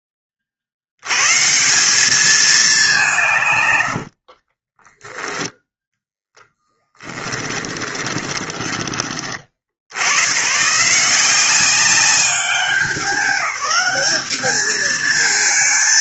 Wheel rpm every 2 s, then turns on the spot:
70, 180, 0, 10, 40, 170, 200, 220.
6-8